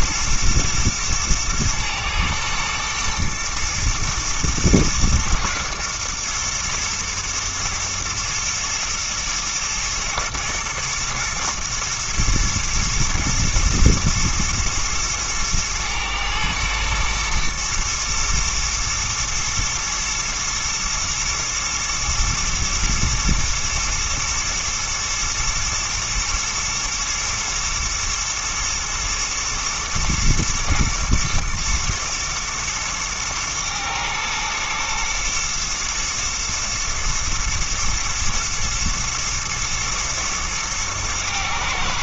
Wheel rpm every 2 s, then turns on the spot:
120, 110, 110, 120, 110, 110, 120, 110, 110, 110, 110, 120, 120, 120, 120, 120, 110, 120, 110, 110, 110.
none